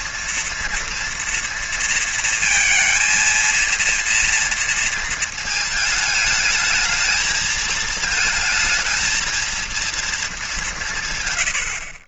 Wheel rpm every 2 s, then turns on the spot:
230, 230, 230, 220, 220, 170.
none